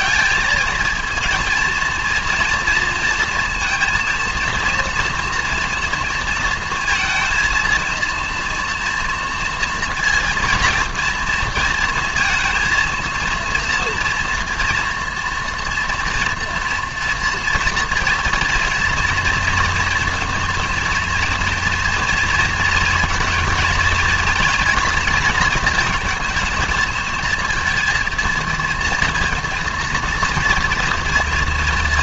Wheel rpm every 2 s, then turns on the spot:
220, 230, 230, 230, 230, 230, 230, 230, 240, 230, 230, 230, 230, 220, 230, 230.
none